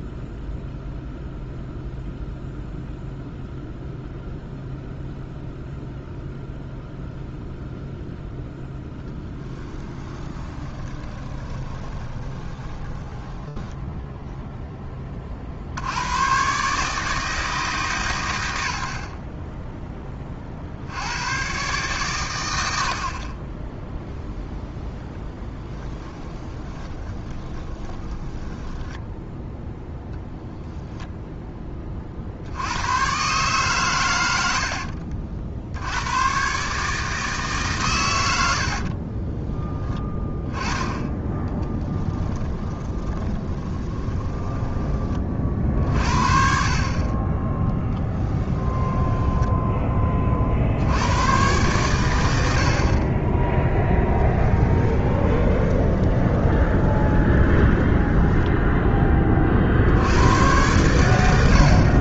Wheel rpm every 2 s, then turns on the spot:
0, 0, 0, 0, 0, 20, 20, 30, 150, 50, 70, 70, 0, 10, 10, 0, 100, 60, 150, 70, 10, 20, 20, 40, 10, 80, 40, 20, 20, 10, 100.
10-14 26-28 34-36 38-40 42-44 48-50 54-58